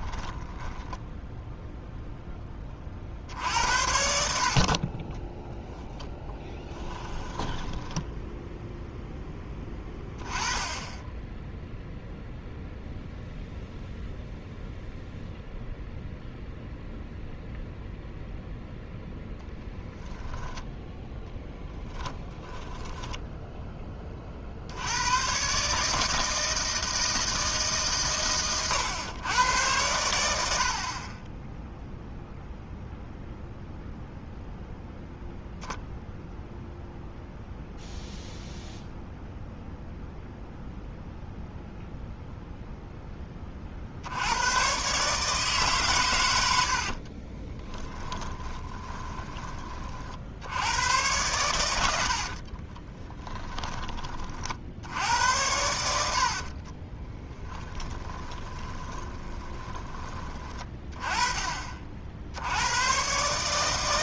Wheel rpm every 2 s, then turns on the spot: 10, 30, 40, 10, 0, 10, 0, 0, 0, 0, 0, 10, 70, 160, 110, 50, 0, 0, 0, 0, 0, 0, 120, 70, 20, 90, 20, 70, 40, 20, 20, 100.
6-8 22-24 46-50 52-54 56-60